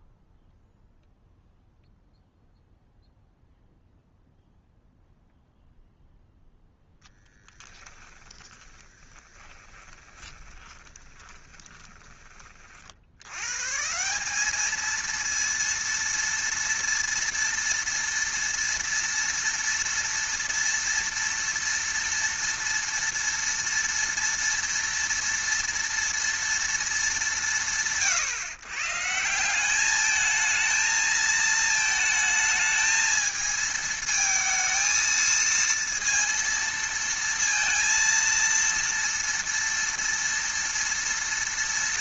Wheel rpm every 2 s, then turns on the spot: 0, 0, 0, 0, 20, 20, 40, 210, 230, 230, 230, 230, 230, 230, 120, 220, 220, 230, 230, 230, 230.
8-12